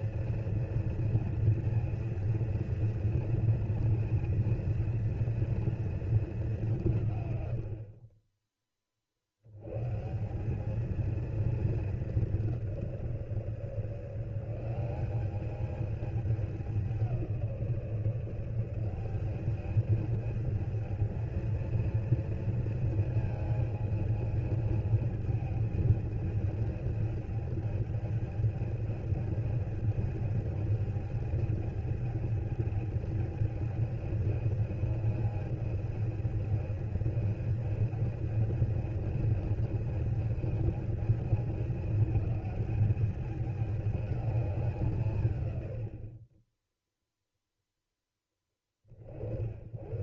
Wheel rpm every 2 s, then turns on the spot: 230, 230, 230, 180, 50, 230, 160, 190, 190, 190, 220, 220, 220, 220, 220, 220, 210, 220, 220, 210, 210, 210, 160, 0, 20.
none